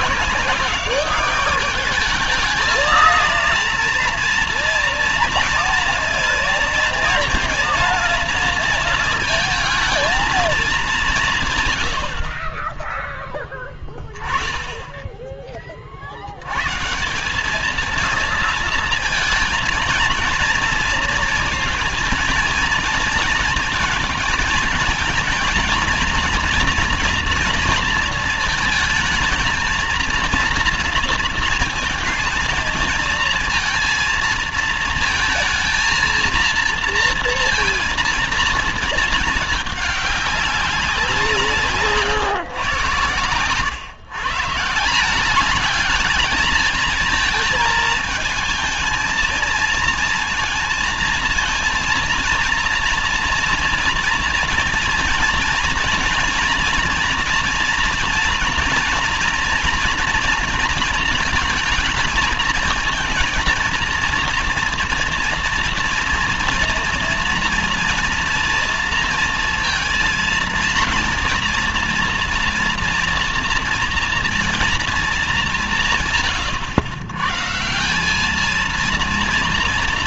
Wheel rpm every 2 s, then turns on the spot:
190, 220, 230, 230, 230, 210, 20, 10, 100, 220, 230, 220, 220, 230, 230, 230, 230, 230, 230, 230, 190, 120, 150, 220, 220, 230, 230, 230, 230, 230, 230, 220, 230, 230, 230, 230, 240, 240, 110, 220.
none